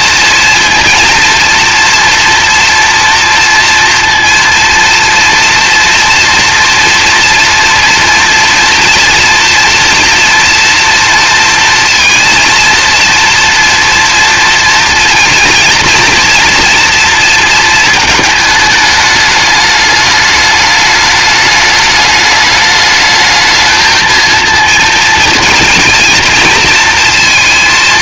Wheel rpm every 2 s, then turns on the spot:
230, 230, 230, 230, 230, 240, 230, 230, 230, 220, 210, 210, 230, 230.
none